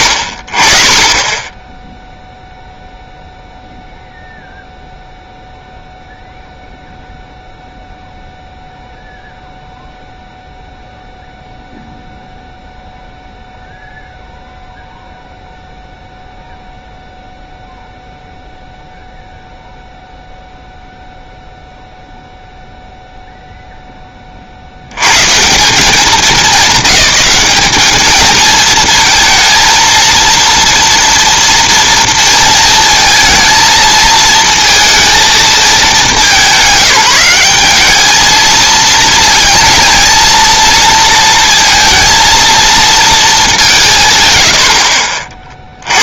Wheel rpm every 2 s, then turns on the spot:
40, 0, 0, 0, 0, 0, 0, 0, 0, 0, 0, 0, 80, 210, 220, 230, 230, 230, 180, 220, 230, 230, 70.
none